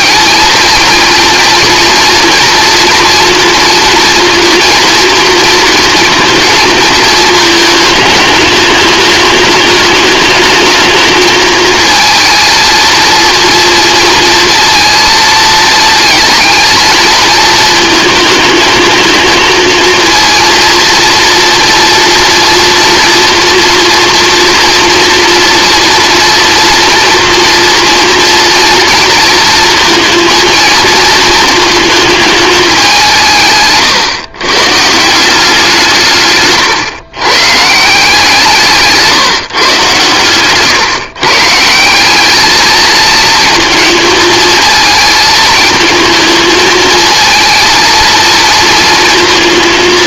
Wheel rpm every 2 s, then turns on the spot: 220, 230, 230, 230, 210, 220, 230, 230, 220, 220, 230, 230, 230, 230, 230, 230, 200, 140, 130, 160, 140, 220, 220, 220, 230.
none